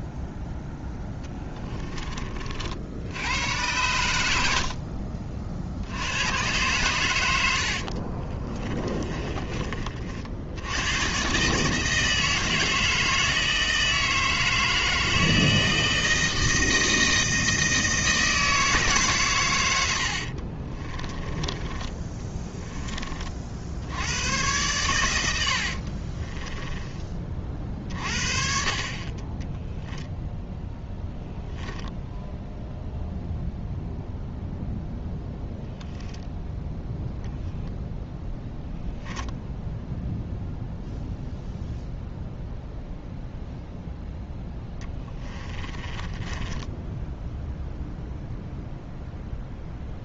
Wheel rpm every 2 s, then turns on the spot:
0, 60, 60, 120, 30, 100, 160, 160, 160, 150, 30, 20, 100, 20, 40, 0, 0, 0, 10, 10, 0, 0, 10, 10, 0.
8-10 20-22 26-28 44-48